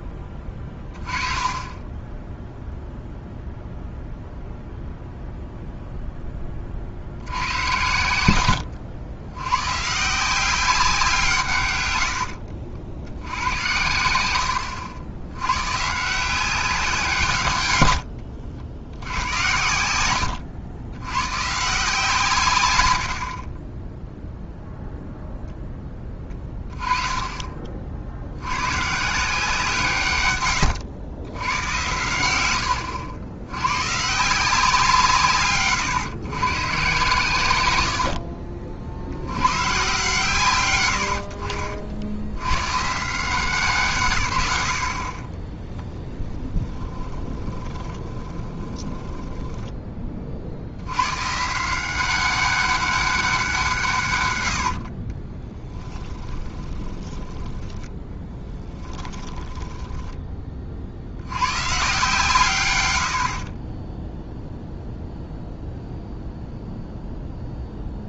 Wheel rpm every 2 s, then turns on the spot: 20, 0, 0, 50, 80, 190, 80, 80, 180, 80, 90, 90, 0, 20, 130, 110, 100, 170, 140, 60, 110, 120, 60, 20, 20, 90, 190, 60, 20, 10, 40, 110, 0, 0.
32-34 46-50 54-60